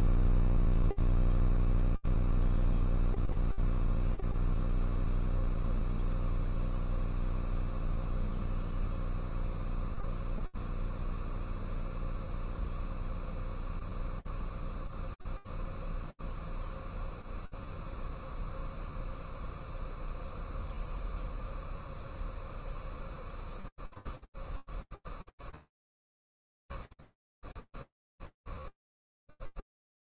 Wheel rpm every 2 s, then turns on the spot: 0, 0, 0, 0, 0, 0, 0, 0, 0, 0, 0, 0, 0, 0, 0.
none